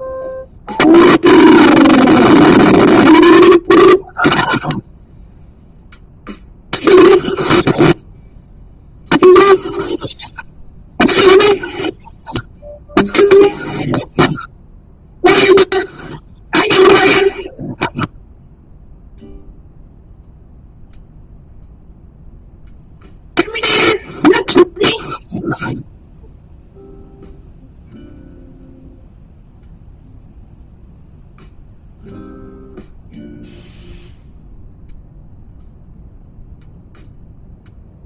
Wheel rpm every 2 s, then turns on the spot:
0, 0, 0, 0, 0, 0, 0, 0, 0, 0, 0, 0, 0, 0, 0, 0, 0, 0, 0.
none